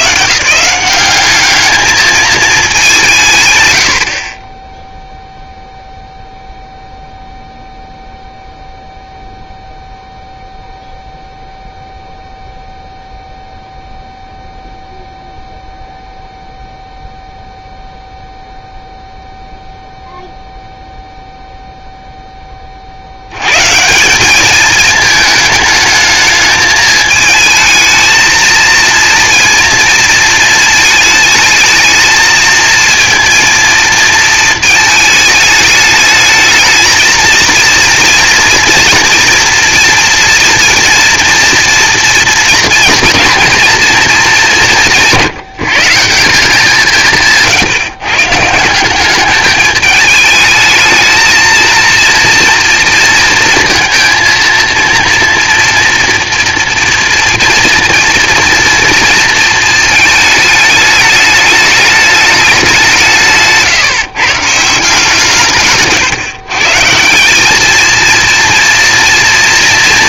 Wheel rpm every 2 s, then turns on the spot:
200, 200, 10, 0, 0, 0, 0, 0, 0, 0, 0, 40, 210, 220, 230, 230, 220, 220, 220, 230, 240, 230, 180, 180, 170, 220, 230, 230, 230, 230, 210, 190, 150, 150, 230.
none